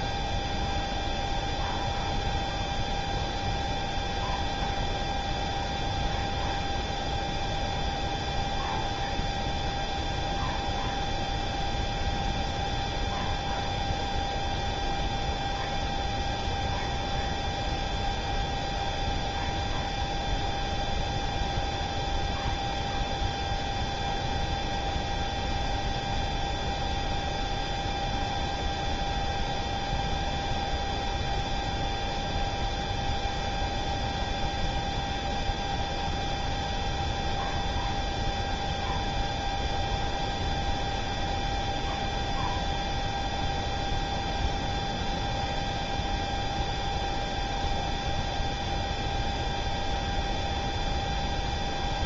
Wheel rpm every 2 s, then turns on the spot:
0, 0, 0, 0, 0, 0, 0, 0, 0, 0, 0, 0, 0, 0, 0, 0, 0, 0, 0, 0, 0, 0, 0, 0, 0, 0.
none